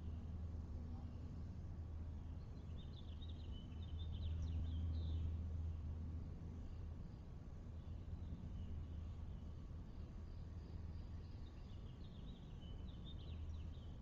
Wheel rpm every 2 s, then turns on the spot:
0, 0, 0, 0, 0, 0, 0.
none